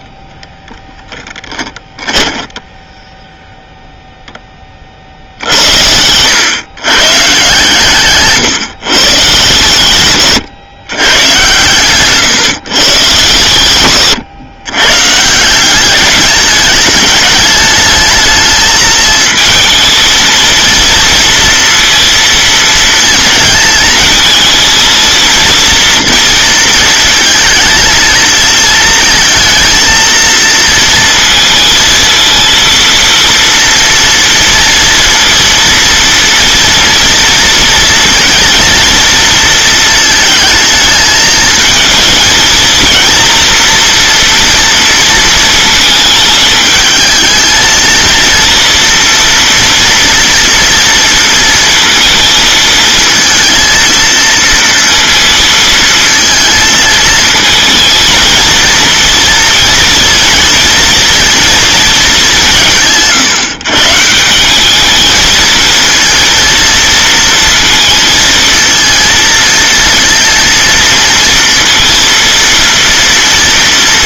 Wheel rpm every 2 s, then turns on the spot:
20, 10, 40, 140, 140, 120, 130, 130, 210, 220, 230, 230, 230, 230, 230, 230, 230, 230, 230, 230, 220, 230, 230, 220, 230, 230, 220, 230, 220, 230, 230, 160, 200, 230, 230, 230, 230.
0-2